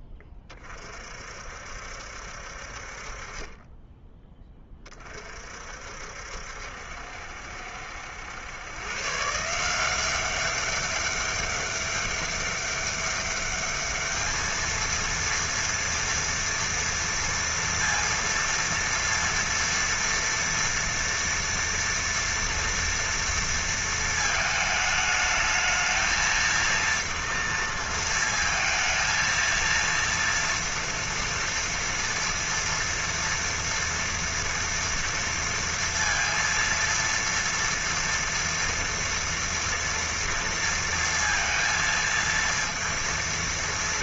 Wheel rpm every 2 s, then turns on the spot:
30, 60, 20, 70, 110, 190, 200, 220, 230, 230, 230, 240, 220, 230, 230, 230, 230, 230, 230, 230, 230, 230.
none